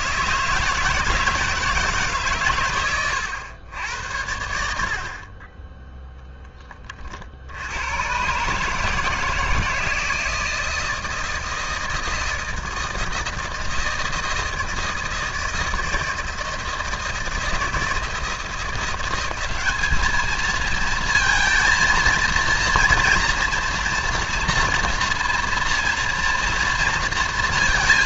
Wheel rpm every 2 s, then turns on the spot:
160, 120, 60, 20, 160, 160, 160, 160, 160, 180, 220, 230, 230, 230.
none